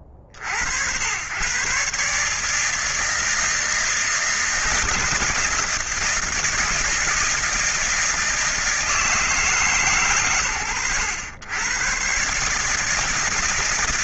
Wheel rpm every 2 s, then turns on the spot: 70, 150, 160, 170, 160, 90, 140.
none